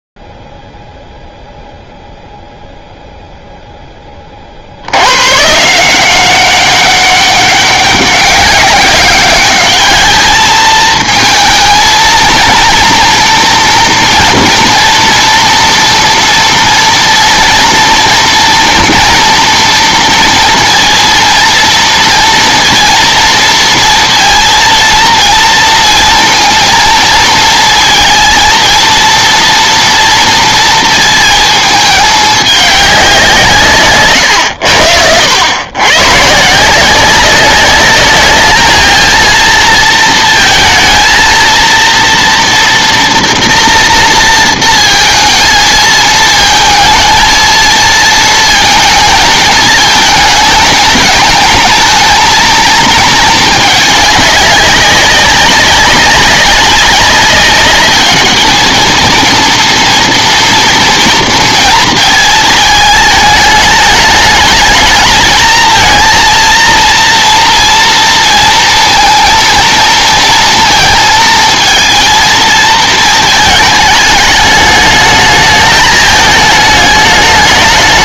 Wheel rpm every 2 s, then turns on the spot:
0, 0, 20, 180, 200, 210, 230, 240, 230, 230, 230, 230, 230, 230, 230, 240, 210, 120, 130, 210, 230, 230, 230, 220, 230, 220, 220, 200, 190, 210, 230, 220, 210, 230, 230, 230, 220, 210, 210.
none